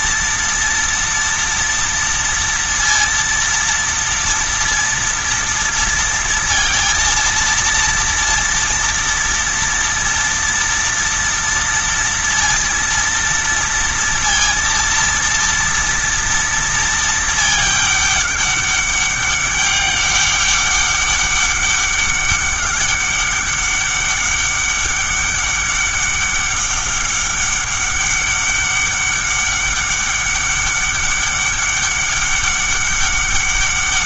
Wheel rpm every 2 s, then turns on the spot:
230, 230, 230, 230, 230, 230, 230, 230, 230, 200, 200, 200, 200, 200, 200, 200, 200.
none